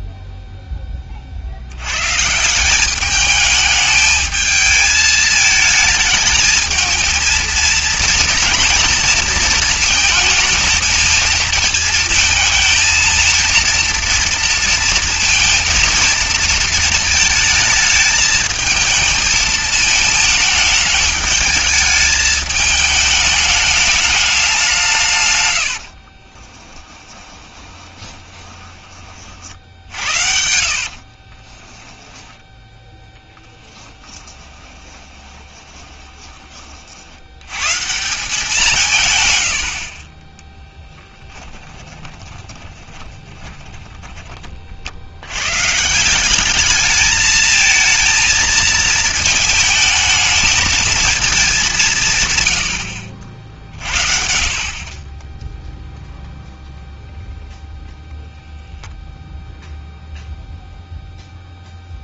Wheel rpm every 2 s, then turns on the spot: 10, 170, 220, 220, 230, 220, 220, 230, 230, 220, 220, 210, 190, 20, 20, 60, 10, 20, 30, 180, 10, 40, 40, 200, 220, 220, 100, 40, 0, 0, 0.
26-32 34-36 40-44